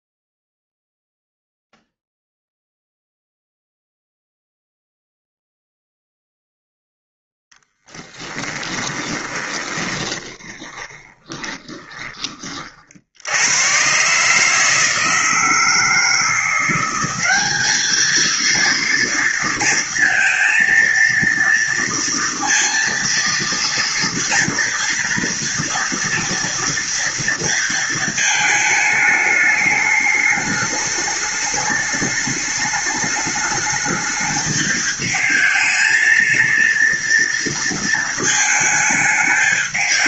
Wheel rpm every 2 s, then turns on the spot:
0, 0, 0, 0, 10, 20, 30, 150, 170, 230, 230, 230, 230, 230, 220, 210, 210, 220, 230, 220.
8-12